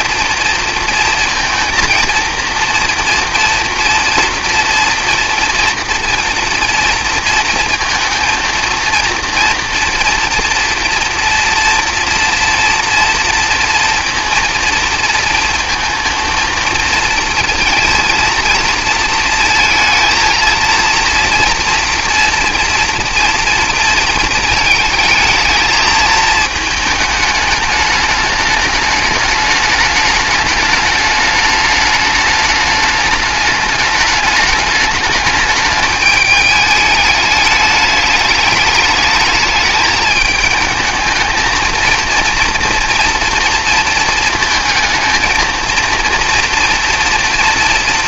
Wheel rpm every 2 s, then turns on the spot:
230, 230, 230, 230, 230, 240, 230, 230, 230, 230, 230, 230, 220, 220, 210, 210, 210, 210, 220, 210, 220, 230, 220, 230.
none